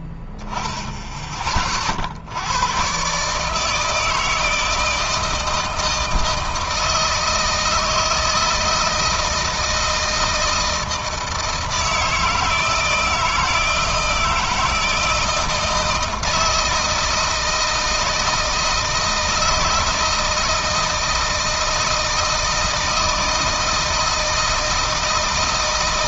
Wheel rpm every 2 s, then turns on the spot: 0, 110, 160, 160, 160, 160, 160, 160, 160, 160, 160, 160, 160.
none